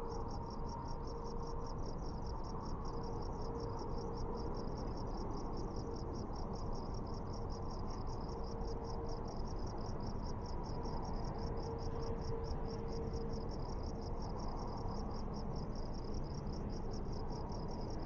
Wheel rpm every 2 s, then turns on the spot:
0, 0, 0, 0, 0, 0, 0, 0, 0.
none